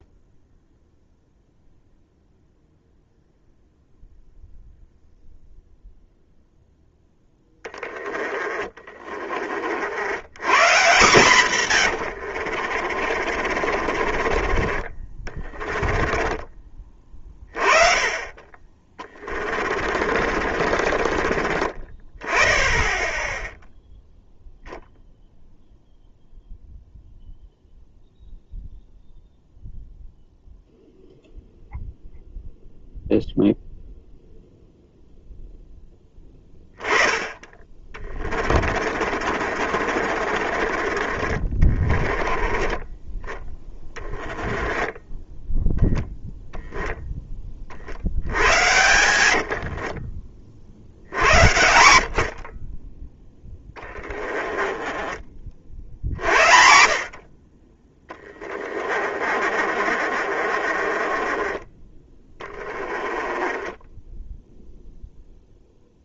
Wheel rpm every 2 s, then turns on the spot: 0, 0, 0, 10, 20, 140, 40, 20, 30, 20, 40, 10, 0, 0, 0, 0, 0, 0, 20, 40, 40, 20, 10, 0, 90, 80, 20, 20, 60, 40, 30, 20, 0.
12-14 18-22 38-40 44-46 48-50 54-56 58-64